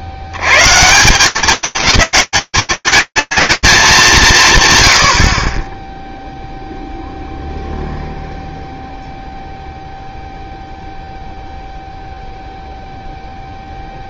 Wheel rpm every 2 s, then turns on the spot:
120, 210, 170, 0, 0, 0, 0.
none